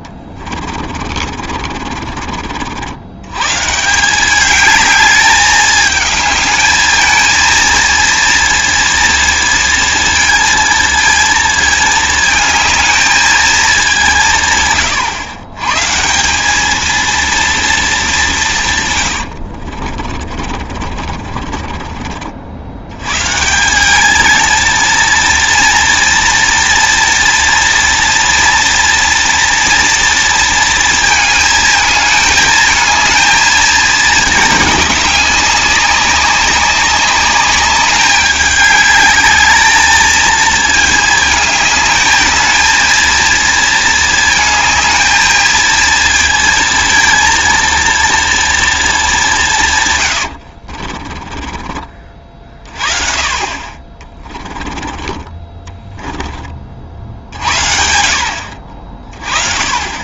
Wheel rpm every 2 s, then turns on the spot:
30, 50, 210, 220, 230, 230, 220, 140, 210, 150, 40, 80, 230, 230, 230, 230, 220, 210, 200, 210, 220, 220, 220, 230, 230, 60, 30, 30, 50, 50.
0-2 20-22 50-52 54-56